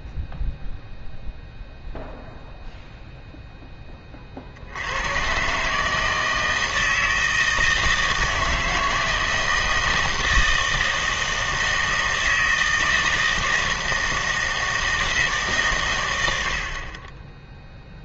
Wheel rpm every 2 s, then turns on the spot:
0, 0, 70, 160, 160, 160, 160, 160, 60.
none